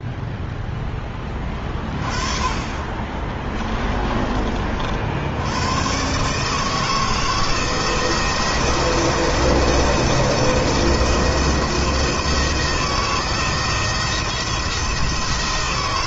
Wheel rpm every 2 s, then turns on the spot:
10, 20, 60, 160, 170, 170, 160, 170.
2-4